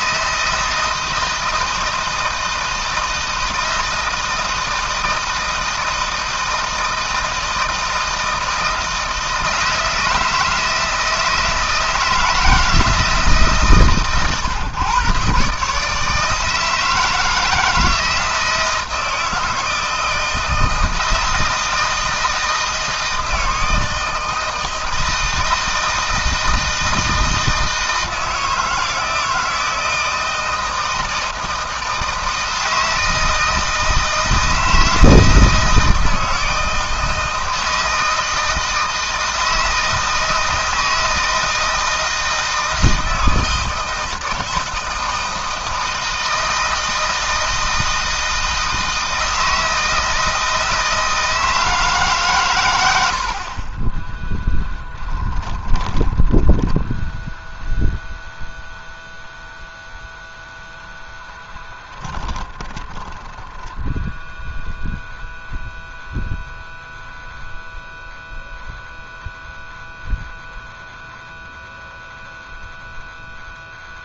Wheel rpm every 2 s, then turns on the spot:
160, 160, 160, 160, 160, 160, 160, 130, 160, 160, 160, 160, 160, 160, 160, 160, 160, 160, 160, 160, 160, 160, 160, 160, 160, 160, 110, 10, 20, 0, 0, 20, 0, 0, 0, 0, 0.
54-58 62-64